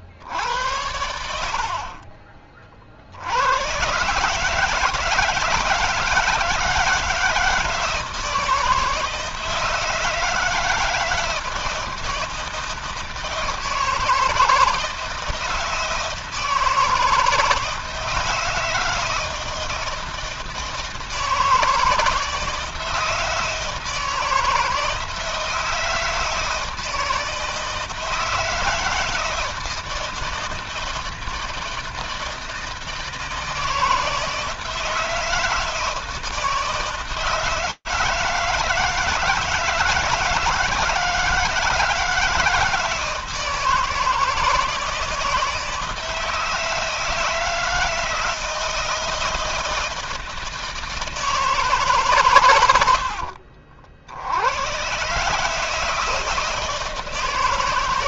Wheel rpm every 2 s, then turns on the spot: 80, 40, 150, 160, 160, 160, 160, 160, 160, 160, 160, 160, 160, 160, 160, 160, 160, 170, 160, 160, 160, 160, 160, 160, 160, 160, 110, 100, 160.
none